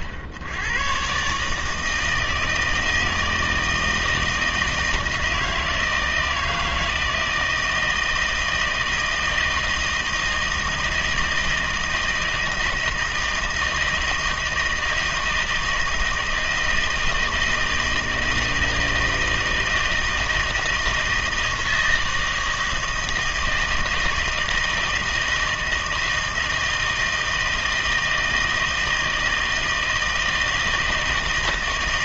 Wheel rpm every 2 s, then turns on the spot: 80, 160, 160, 160, 160, 160, 160, 160, 160, 160, 160, 160, 160, 160, 160, 160.
none